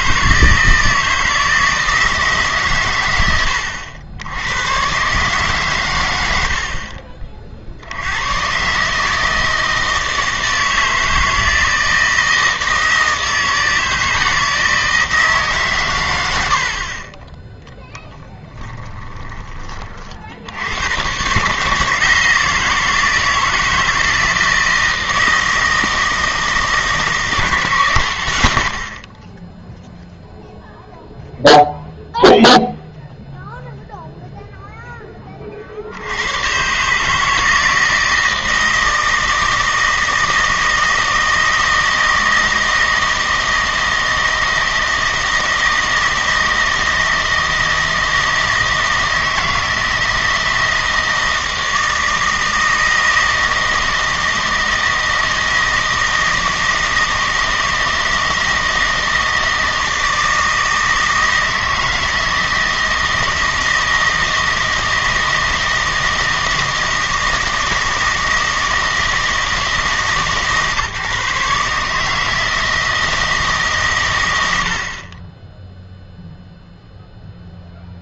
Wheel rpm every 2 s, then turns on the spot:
160, 130, 100, 60, 130, 160, 160, 160, 60, 20, 100, 160, 170, 160, 80, 0, 0, 0, 130, 160, 160, 160, 160, 160, 160, 160, 160, 160, 160, 160, 160, 160, 160, 160, 160, 140, 160, 70, 0.
6-8 18-20